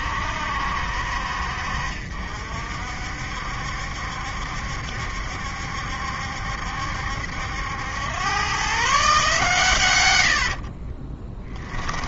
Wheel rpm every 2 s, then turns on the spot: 60, 60, 70, 70, 130, 50.
10-12